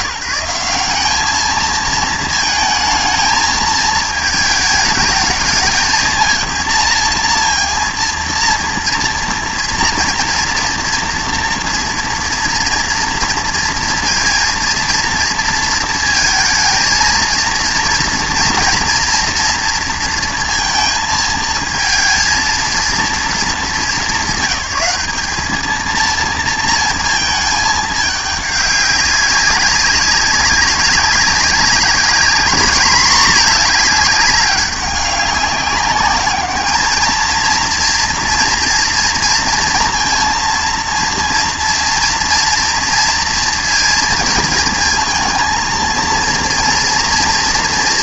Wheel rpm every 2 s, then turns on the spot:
180, 220, 220, 230, 230, 240, 230, 230, 230, 230, 230, 220, 210, 230, 200, 200, 210, 200, 210, 230, 230, 230, 220, 230.
none